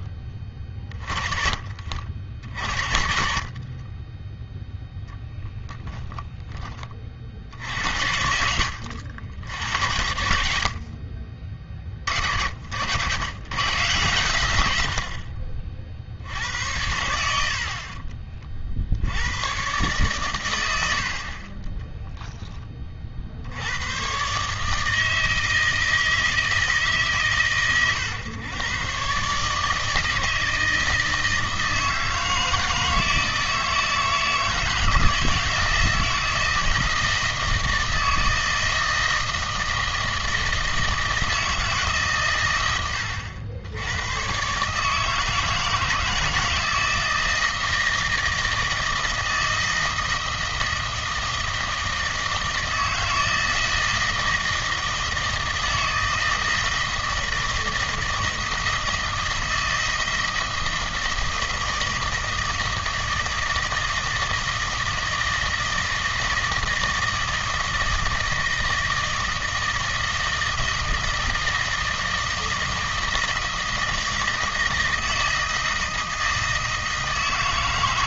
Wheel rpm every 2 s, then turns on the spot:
30, 60, 0, 30, 80, 50, 70, 100, 80, 50, 100, 20, 150, 160, 120, 160, 160, 160, 160, 160, 160, 110, 140, 160, 160, 160, 160, 160, 160, 160, 160, 160, 160, 160, 160, 160, 160, 160, 160.
none